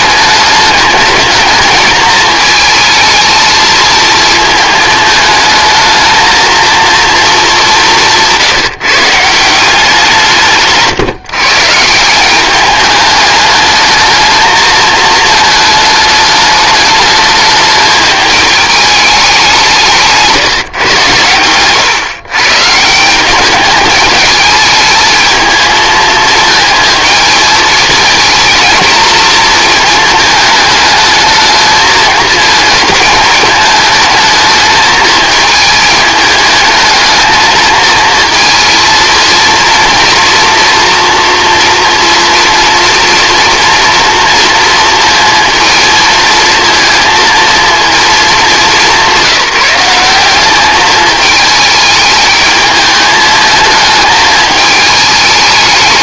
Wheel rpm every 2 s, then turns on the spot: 210, 230, 220, 230, 160, 140, 200, 220, 210, 210, 140, 140, 210, 220, 230, 220, 220, 220, 220, 230, 240, 230, 230, 230, 200, 200, 210, 210.
none